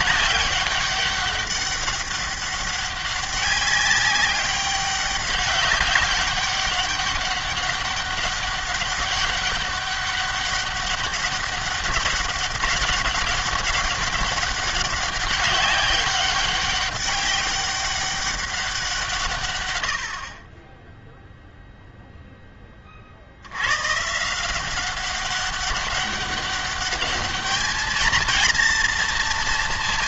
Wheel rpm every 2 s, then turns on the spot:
200, 200, 200, 200, 190, 200, 200, 200, 200, 190, 20, 20, 190, 200, 230.
none